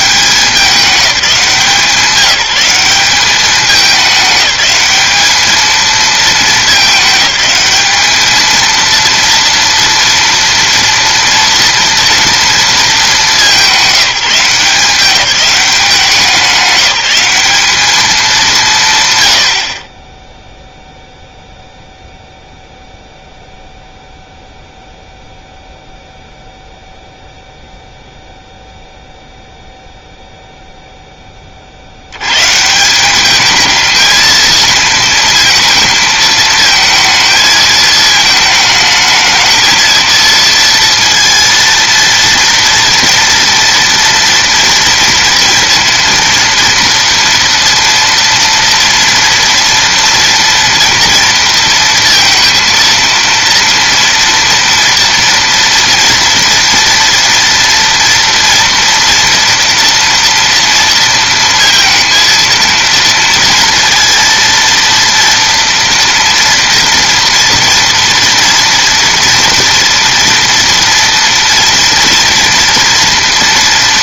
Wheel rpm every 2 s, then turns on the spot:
190, 190, 210, 210, 230, 230, 220, 180, 200, 160, 0, 0, 0, 0, 0, 0, 160, 220, 220, 220, 230, 230, 230, 230, 230, 230, 230, 230, 230, 230, 230, 230, 230, 230, 230, 230, 230.
none